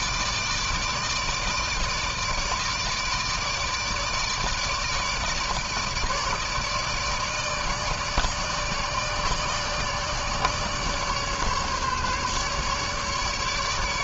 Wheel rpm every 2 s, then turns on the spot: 150, 150, 160, 150, 150, 150, 150.
none